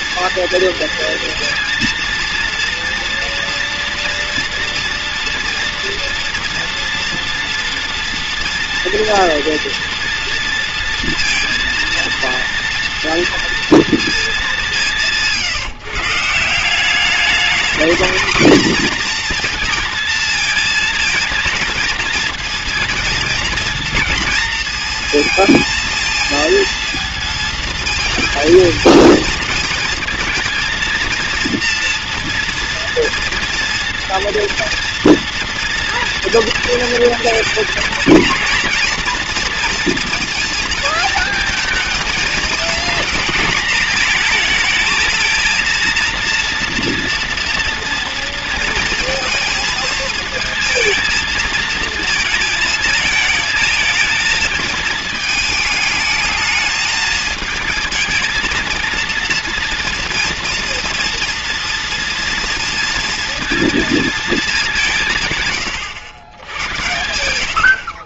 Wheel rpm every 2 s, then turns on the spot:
230, 230, 230, 230, 230, 230, 230, 170, 200, 230, 230, 230, 230, 230, 220, 230, 230, 240, 230, 230, 230, 220, 220, 240, 230, 230, 220, 220, 210, 220, 230, 230, 200, 90.
66-68